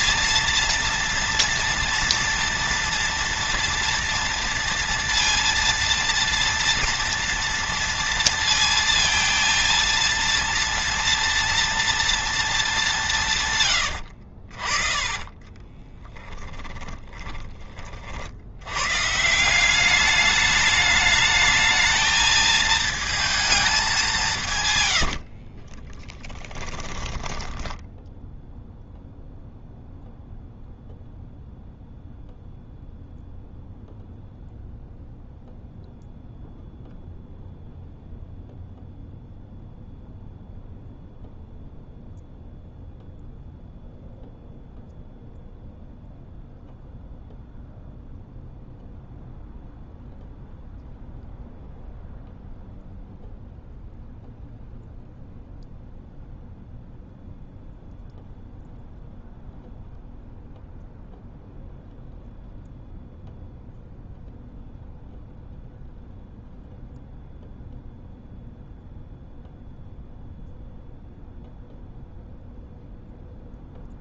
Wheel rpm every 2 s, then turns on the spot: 230, 230, 230, 230, 230, 230, 180, 30, 20, 120, 210, 220, 110, 10, 0, 0, 0, 0, 0, 0, 0, 0, 0, 0, 0, 0, 0, 0, 0, 0, 0, 0, 0, 0, 0, 0, 0.
14-18 24-28